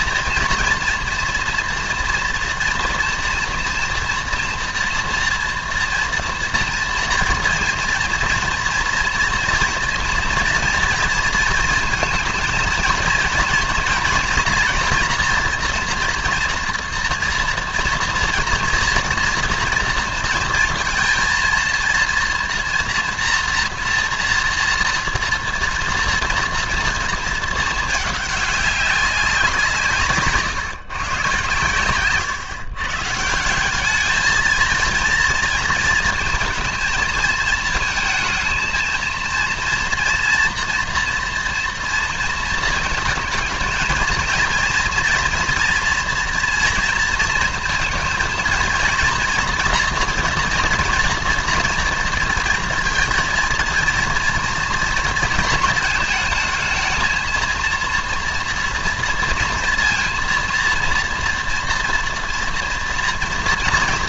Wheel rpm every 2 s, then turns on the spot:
230, 230, 230, 230, 230, 230, 230, 230, 230, 240, 230, 230, 230, 230, 200, 140, 140, 230, 230, 220, 230, 230, 230, 230, 230, 230, 230, 230, 220, 240, 240, 230.
none